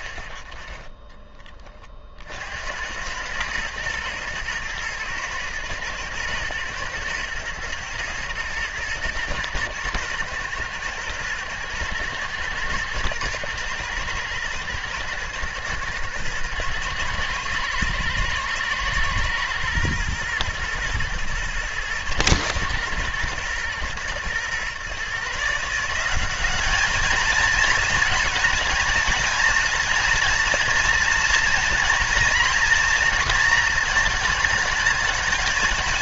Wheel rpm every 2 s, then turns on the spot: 10, 80, 110, 110, 110, 110, 110, 110, 120, 120, 110, 120, 130, 210, 230, 230, 230, 220.
none